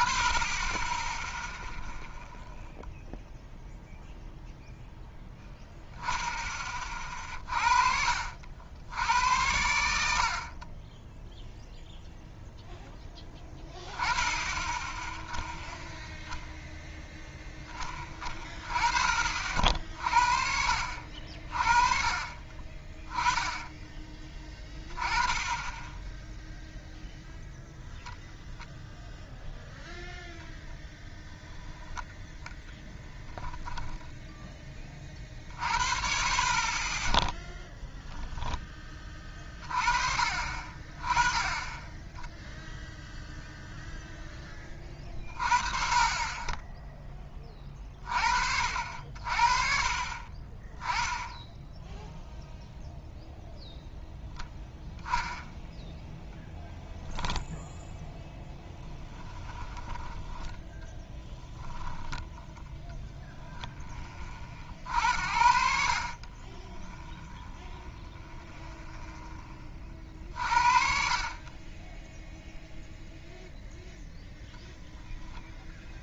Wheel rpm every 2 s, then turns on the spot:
20, 0, 0, 20, 80, 30, 0, 10, 0, 30, 60, 30, 20, 0, 0, 0, 10, 20, 30, 10, 30, 0, 20, 10, 60, 20, 0, 0, 10, 10, 10, 0, 50, 10, 0, 50, 0, 0.
32-34 58-62